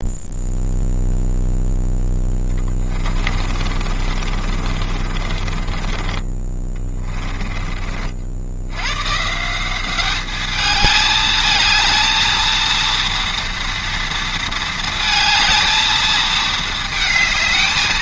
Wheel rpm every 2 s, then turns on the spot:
0, 20, 40, 20, 90, 210, 230, 230, 220.
2-8